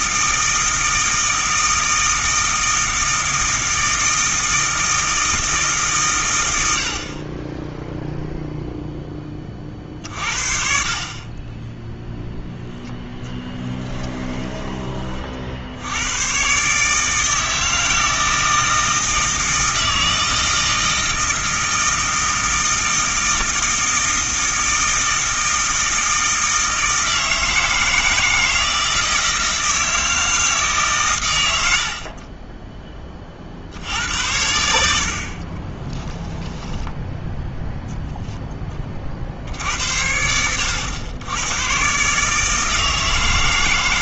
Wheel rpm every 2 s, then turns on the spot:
160, 160, 160, 80, 0, 50, 0, 20, 140, 160, 160, 160, 160, 160, 160, 140, 20, 80, 10, 20, 90, 160.
none